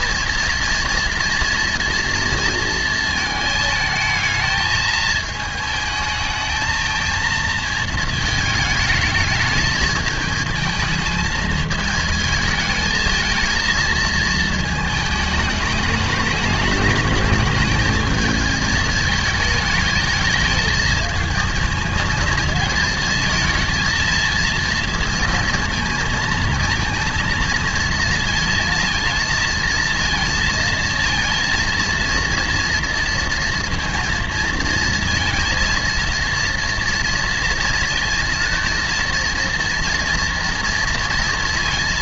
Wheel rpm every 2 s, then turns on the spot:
230, 220, 220, 220, 210, 220, 220, 220, 210, 210, 220, 220, 230, 230, 220, 230, 230, 230, 230, 230, 230.
none